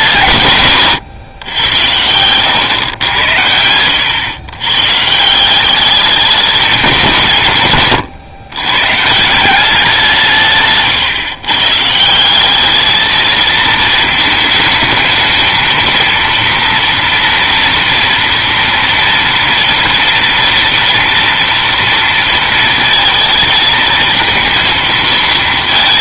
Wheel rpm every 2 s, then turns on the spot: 140, 110, 120, 210, 120, 140, 200, 220, 230, 230, 230, 230, 230.
none